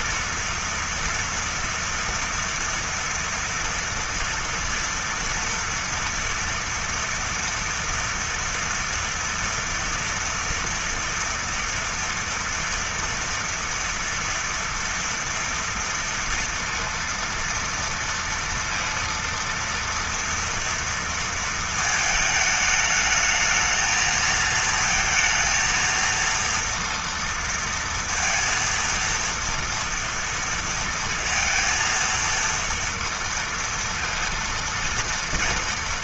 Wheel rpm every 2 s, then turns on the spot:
230, 230, 230, 230, 230, 230, 230, 230, 230, 230, 230, 210, 230, 230, 230, 230, 230, 230.
none